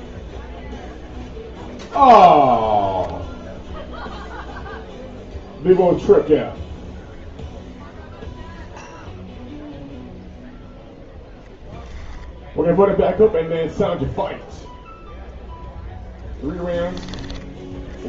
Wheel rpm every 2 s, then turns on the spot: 0, 0, 0, 0, 0, 0, 10, 0, 20.
16-18